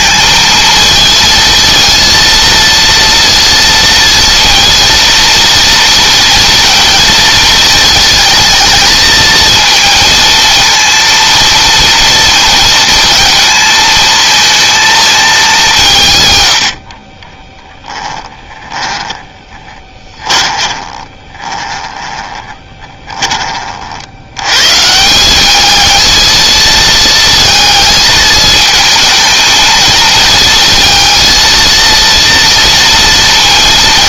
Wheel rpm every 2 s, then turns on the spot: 220, 230, 230, 230, 220, 230, 220, 220, 40, 20, 30, 20, 170, 220, 220, 230, 230.
16-22